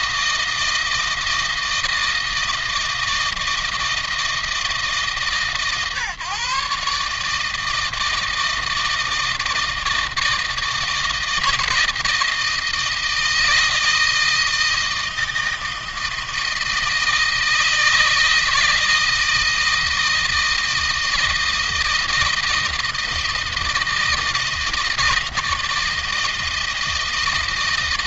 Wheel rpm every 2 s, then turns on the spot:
160, 160, 160, 150, 160, 160, 160, 160, 160, 160, 160, 160, 160, 160.
none